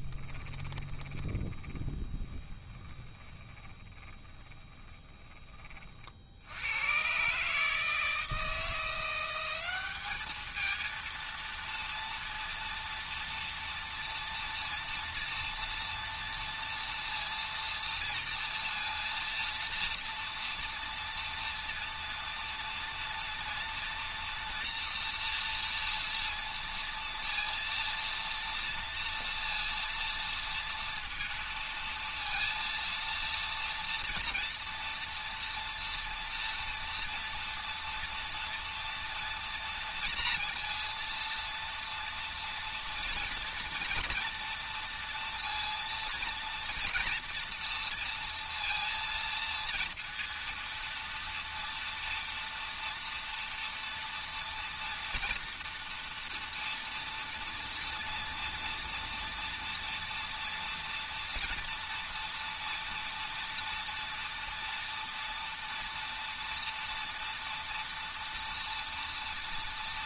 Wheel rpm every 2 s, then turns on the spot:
20, 30, 10, 110, 170, 220, 230, 230, 230, 230, 240, 230, 230, 230, 230, 230, 230, 230, 240, 230, 230, 230, 230, 230, 230, 230, 240, 230, 230, 230, 230, 230, 230, 230, 230.
0-6